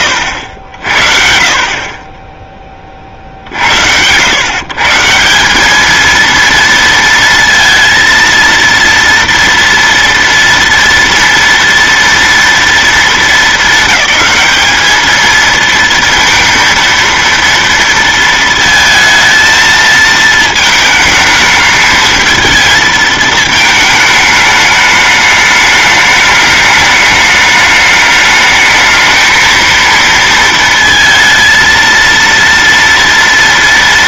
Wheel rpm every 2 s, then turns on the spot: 60, 40, 150, 230, 230, 230, 220, 210, 230, 230, 220, 220, 210, 210, 220, 230, 230.
none